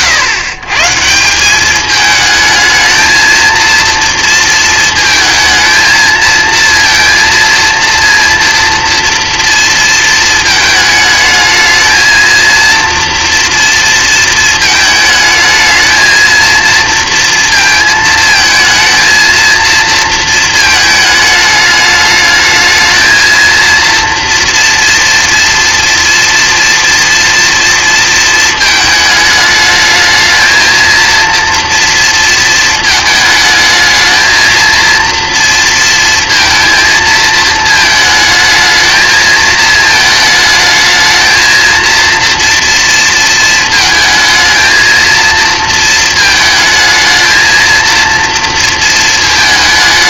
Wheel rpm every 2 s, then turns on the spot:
140, 220, 230, 230, 230, 220, 230, 220, 230, 220, 220, 220, 240, 230, 220, 220, 230, 230, 230, 220, 220, 230, 230, 220, 230.
none